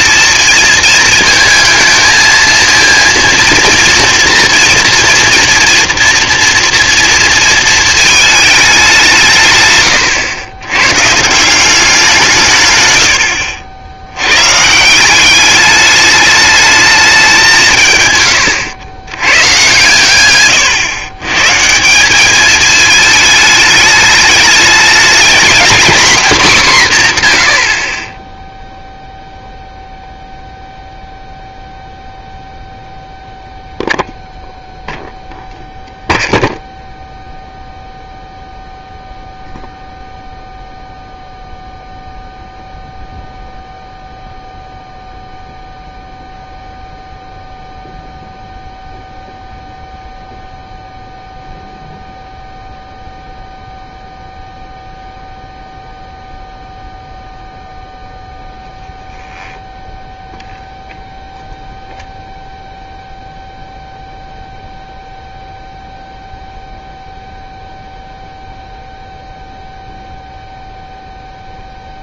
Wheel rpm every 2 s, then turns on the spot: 230, 230, 230, 240, 200, 110, 120, 150, 210, 110, 130, 210, 210, 180, 0, 0, 0, 0, 0, 0, 0, 0, 0, 0, 0, 0, 0, 0, 0, 0, 0, 0, 0, 0, 0, 0.
12-14